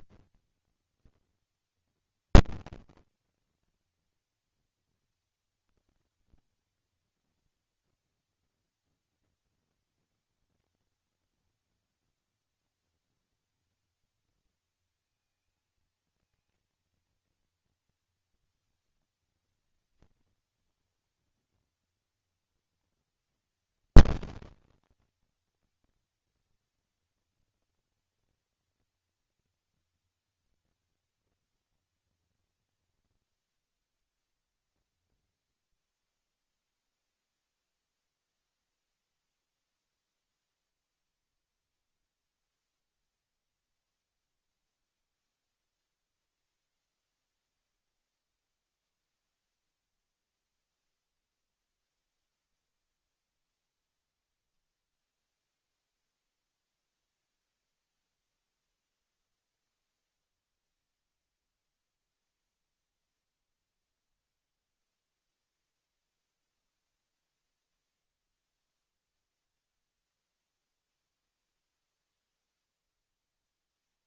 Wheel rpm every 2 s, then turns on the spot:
230, 230, 230, 230, 230, 230, 230, 220, 230, 210, 230, 210, 230, 230, 230, 230, 70, 50, 0, 0, 0, 0, 0, 0, 0, 0, 0, 0, 0, 0, 0, 0, 0, 0, 0, 0, 0.
none